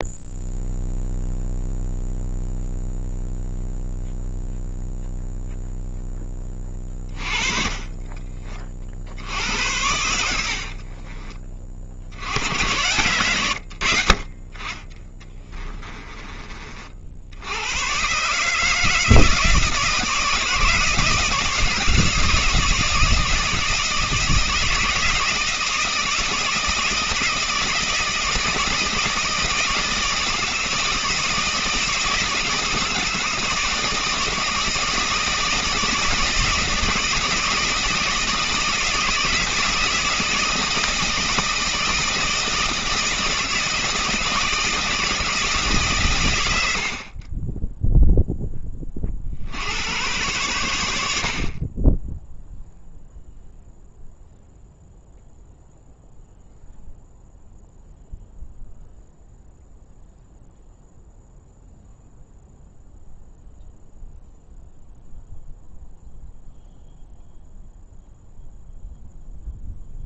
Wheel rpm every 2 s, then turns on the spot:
0, 0, 0, 20, 40, 50, 100, 40, 40, 150, 160, 170, 160, 170, 160, 160, 160, 160, 160, 160, 170, 160, 160, 90, 10, 100, 0, 0, 0, 0, 0, 0, 0, 0, 0.
10-12